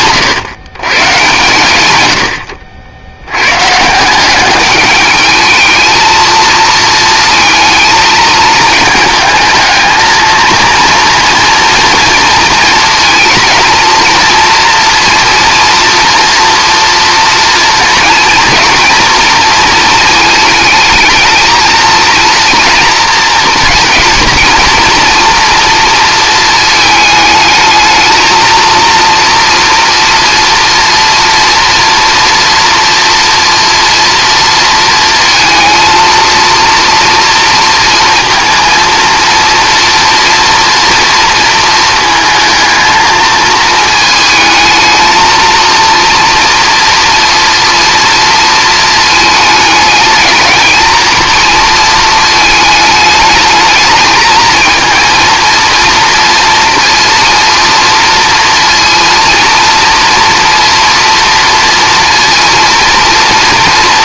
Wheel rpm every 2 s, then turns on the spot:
120, 90, 200, 230, 220, 230, 220, 230, 240, 230, 220, 230, 230, 220, 230, 230, 240, 230, 230, 230, 240, 220, 220, 230, 220, 220, 220, 230, 230, 230, 240, 230.
none